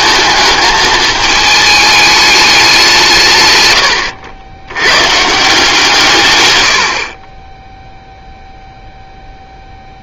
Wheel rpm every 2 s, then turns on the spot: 220, 200, 110, 90, 0.
none